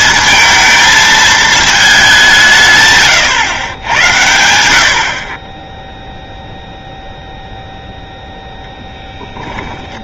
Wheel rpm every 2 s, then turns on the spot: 220, 140, 80, 0, 0.
none